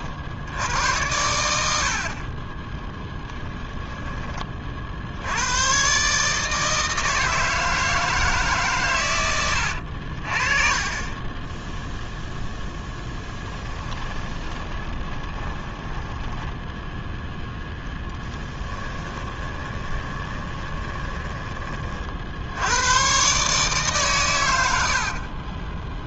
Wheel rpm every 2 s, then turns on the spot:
80, 10, 40, 160, 130, 30, 0, 20, 0, 20, 20, 90, 80.
14-16 18-22